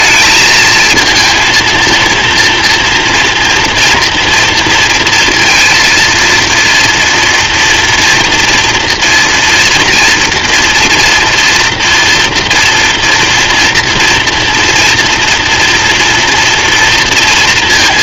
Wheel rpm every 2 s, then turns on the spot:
220, 240, 230, 230, 230, 230, 230, 230, 230.
none